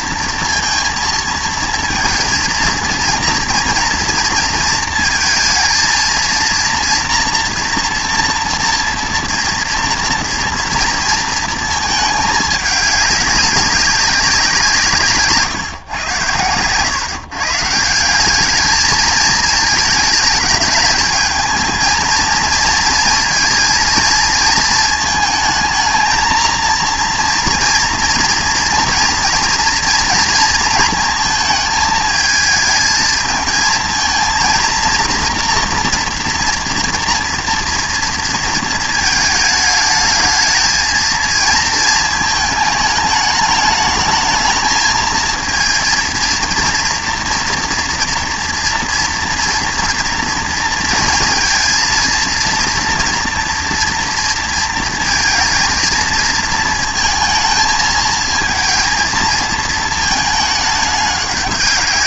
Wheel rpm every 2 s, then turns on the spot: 230, 230, 220, 230, 240, 230, 210, 170, 110, 210, 220, 230, 220, 230, 240, 230, 220, 230, 230, 230, 220, 210, 220, 240, 230, 230, 230, 230, 230, 230, 210.
none